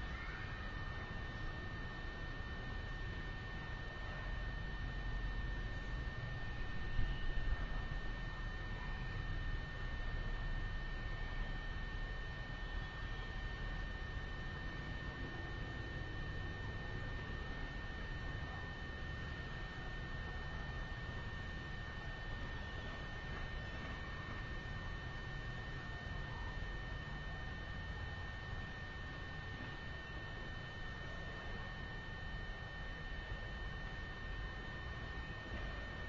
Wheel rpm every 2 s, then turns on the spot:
0, 0, 0, 0, 0, 0, 0, 0, 0, 0, 0, 0, 0, 0, 0, 0, 0, 0.
none